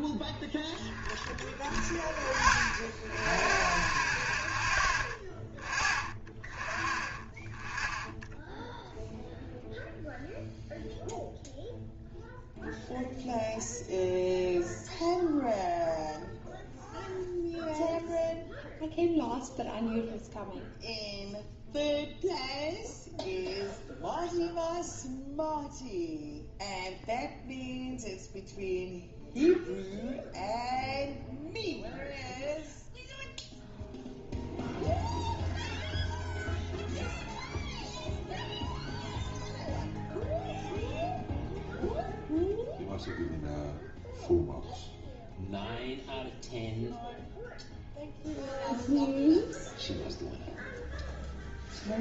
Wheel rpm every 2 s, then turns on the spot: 0, 0, 0, 0, 0, 0, 0, 0, 0, 0, 0, 0, 0, 0, 0, 0, 0, 0, 0, 0, 0, 0, 0, 0, 0, 0.
none